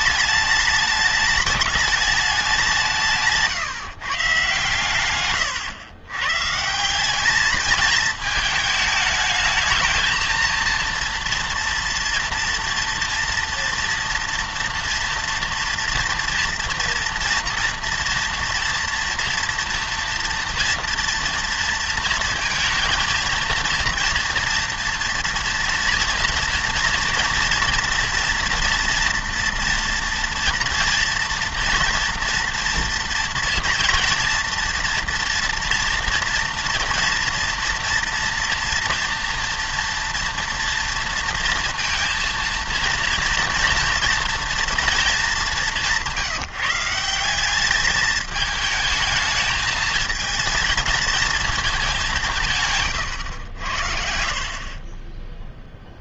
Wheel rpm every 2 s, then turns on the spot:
210, 180, 120, 150, 220, 230, 230, 230, 230, 230, 230, 230, 230, 230, 230, 230, 230, 230, 230, 230, 240, 230, 230, 160, 210, 220, 150, 40.
none